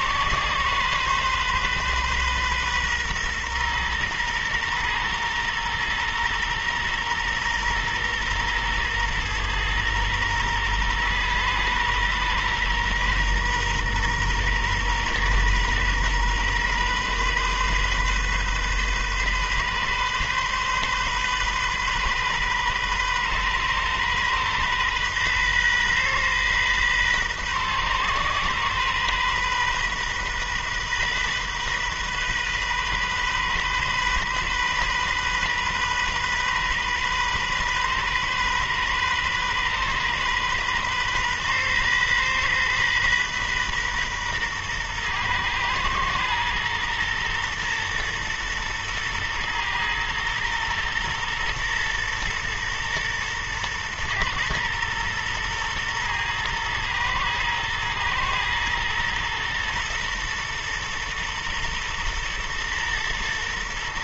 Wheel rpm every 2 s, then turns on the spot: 130, 130, 120, 120, 120, 120, 120, 120, 130, 130, 130, 130, 130, 130, 130, 130, 130, 130, 130, 130, 130, 130, 120, 120, 120, 120, 120, 120, 120, 120, 120, 120.
none